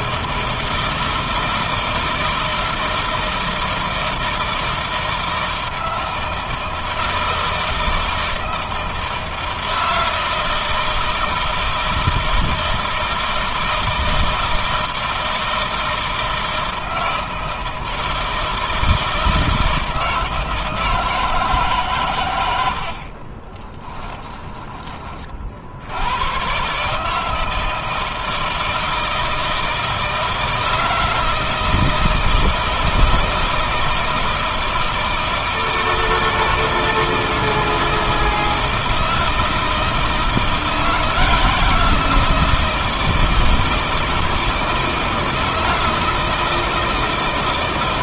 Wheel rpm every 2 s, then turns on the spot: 160, 160, 160, 160, 160, 160, 160, 160, 160, 160, 160, 80, 20, 130, 160, 160, 160, 160, 160, 160, 170, 170, 160, 160.
none